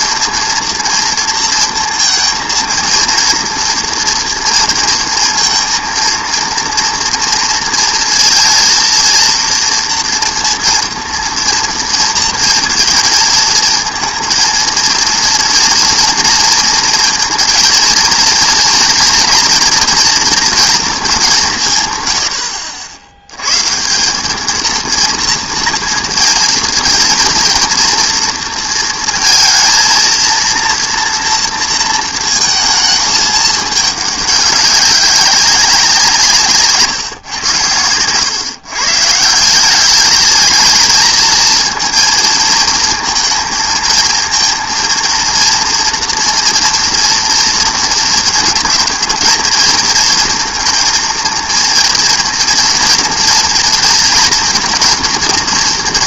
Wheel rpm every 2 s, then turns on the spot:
230, 230, 230, 230, 230, 230, 230, 230, 230, 230, 230, 80, 220, 230, 230, 230, 220, 200, 150, 120, 210, 230, 230, 230, 230, 230, 230, 230.
none